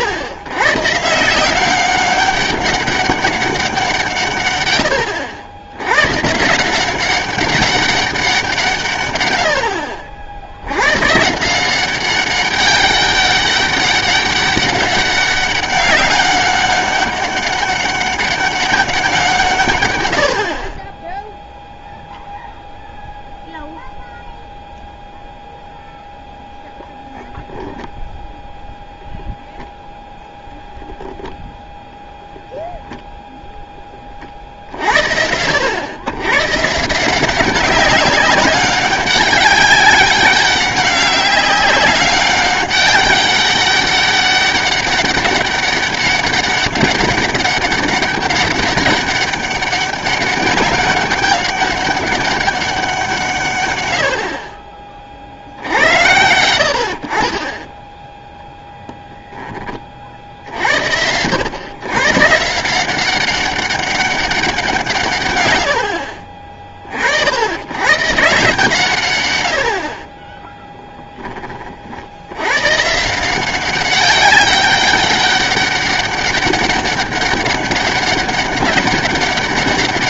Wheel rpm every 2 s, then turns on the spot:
130, 200, 110, 170, 160, 90, 200, 200, 200, 200, 40, 0, 0, 0, 0, 0, 0, 60, 140, 200, 190, 200, 200, 200, 200, 200, 190, 40, 70, 0, 70, 170, 190, 40, 150, 10, 120, 190, 200, 200.
70-72